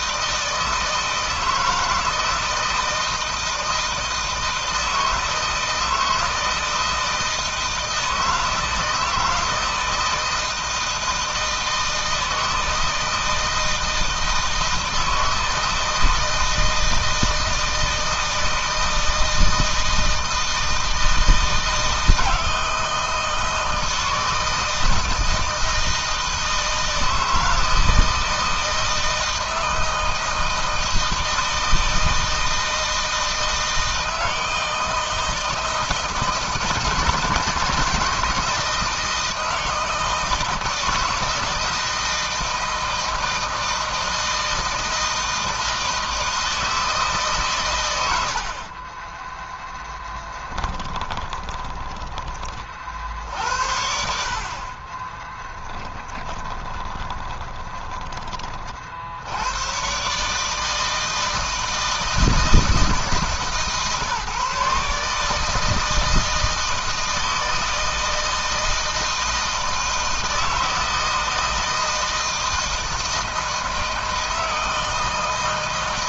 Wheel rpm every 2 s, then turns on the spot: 160, 160, 160, 160, 160, 160, 160, 160, 160, 160, 160, 160, 160, 160, 160, 160, 160, 160, 160, 160, 160, 160, 160, 160, 60, 10, 30, 50, 20, 30, 150, 160, 150, 160, 160, 160, 160, 160.
56-58